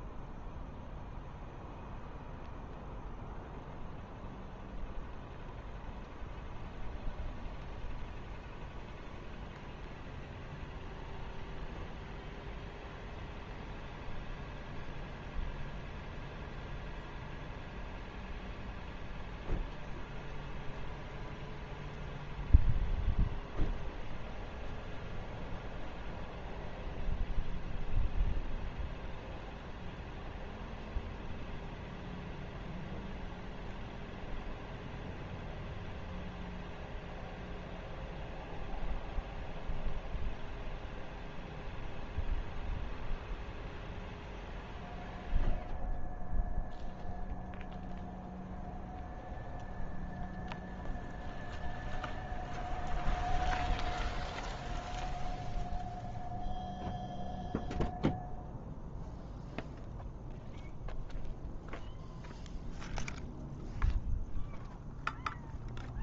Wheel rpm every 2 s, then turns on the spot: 0, 0, 0, 0, 0, 0, 0, 0, 0, 0, 0, 0, 0, 0, 0, 0, 0, 0, 0, 0, 0, 0, 0, 0, 0, 0, 0, 0, 0, 0, 0, 0, 0.
none